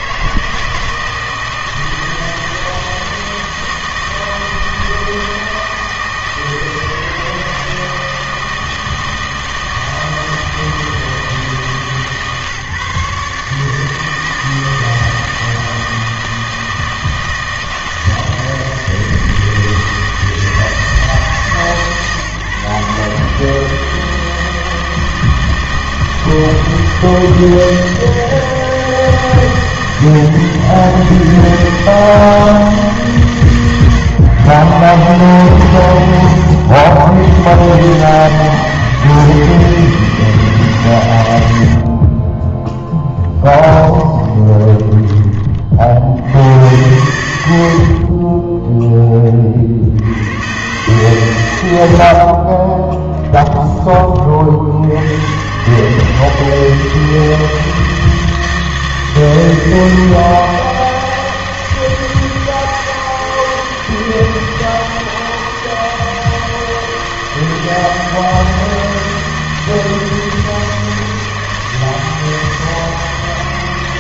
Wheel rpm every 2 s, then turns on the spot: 160, 160, 160, 160, 160, 160, 150, 160, 160, 160, 160, 140, 160, 160, 160, 150, 160, 130, 70, 160, 140, 10, 20, 100, 10, 120, 30, 60, 160, 160, 160, 160, 160, 160, 160, 160, 160.
42-46 52-54